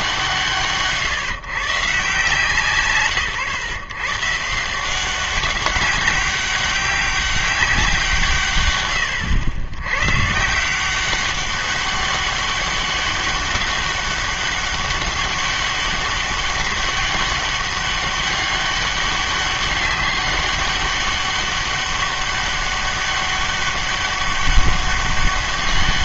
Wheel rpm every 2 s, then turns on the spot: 160, 150, 160, 190, 150, 140, 200, 200, 200, 200, 200, 200, 200.
none